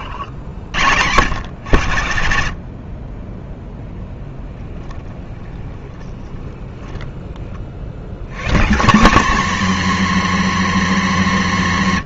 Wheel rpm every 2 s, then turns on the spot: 80, 50, 10, 10, 170, 270.
4-8